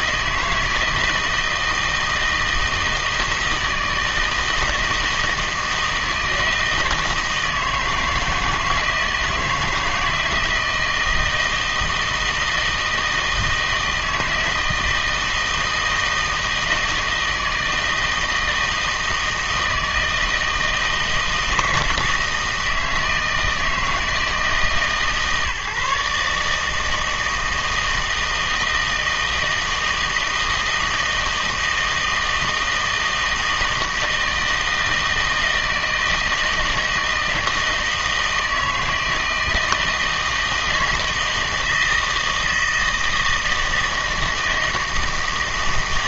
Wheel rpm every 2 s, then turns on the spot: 160, 160, 160, 160, 160, 160, 160, 160, 160, 160, 160, 160, 150, 150, 160, 160, 160, 160, 160, 160, 170, 160, 160.
none